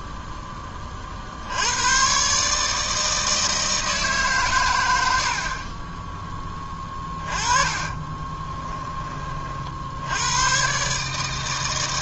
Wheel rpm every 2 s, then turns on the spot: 10, 140, 130, 10, 20, 110.
8-10